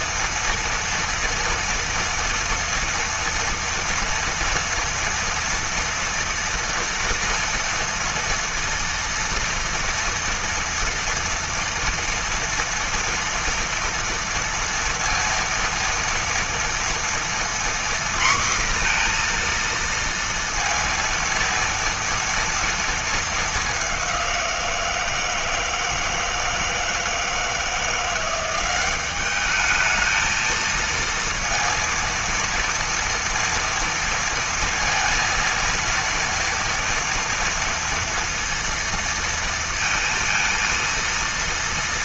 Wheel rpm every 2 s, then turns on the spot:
230, 240, 230, 230, 230, 230, 230, 230, 230, 240, 230, 230, 170, 160, 190, 220, 230, 230, 230, 230, 230.
none